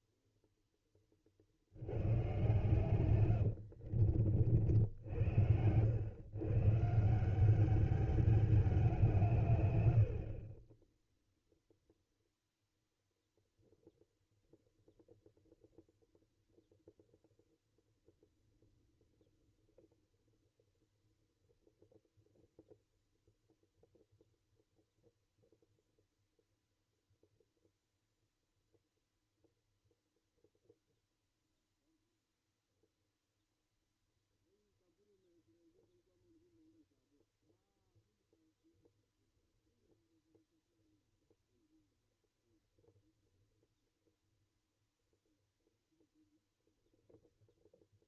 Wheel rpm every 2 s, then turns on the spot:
20, 120, 70, 160, 190, 20, 0, 0, 0, 0, 0, 0, 0, 0, 0, 0, 0, 0, 0, 0, 0, 0, 0, 0.
2-4